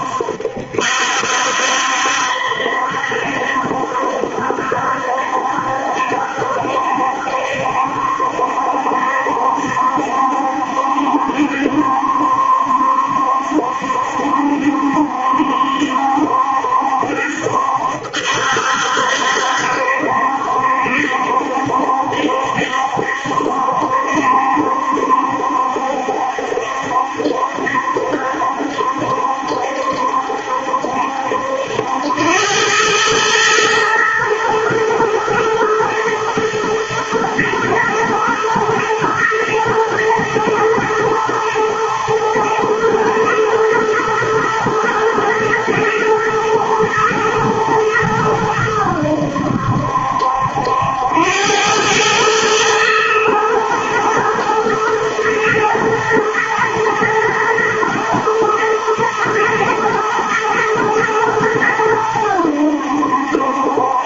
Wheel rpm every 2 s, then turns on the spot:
70, 70, 70, 70, 70, 70, 70, 70, 70, 70, 70, 70, 70, 70, 70, 70, 100, 110, 110, 110, 110, 110, 110, 110, 90, 80, 110, 120, 110, 110, 110, 80.
none